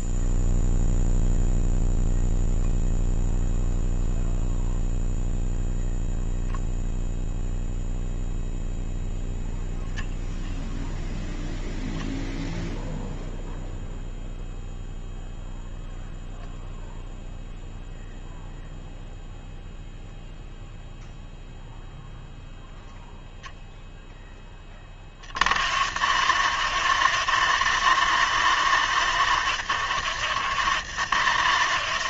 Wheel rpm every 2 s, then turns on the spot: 0, 0, 0, 0, 0, 20, 10, 0, 0, 0, 0, 0, 20, 160, 160, 170.
none